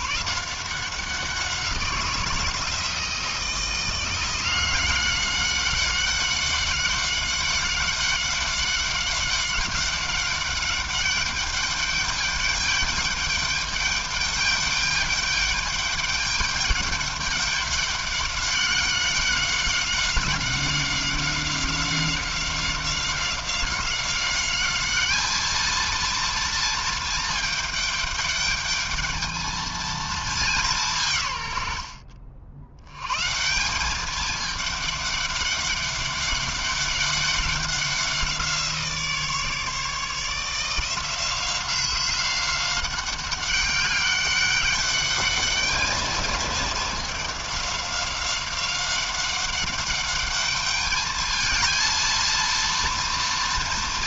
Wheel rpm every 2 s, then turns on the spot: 170, 160, 170, 190, 190, 200, 210, 210, 210, 200, 190, 190, 200, 230, 210, 200, 70, 210, 200, 180, 160, 190, 200, 220, 190, 210, 230.
none